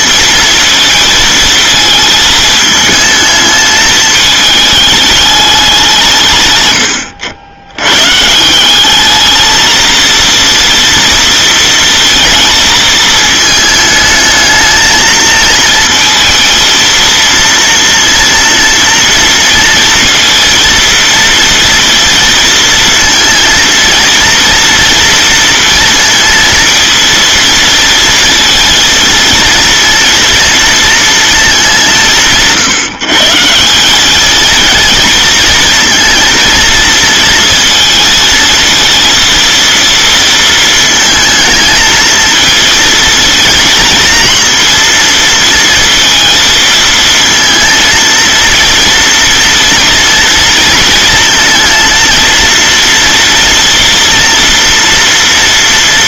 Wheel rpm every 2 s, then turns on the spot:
220, 220, 210, 100, 180, 230, 220, 220, 230, 230, 230, 230, 230, 230, 230, 230, 160, 220, 230, 230, 230, 230, 230, 230, 230, 230, 230, 230.
none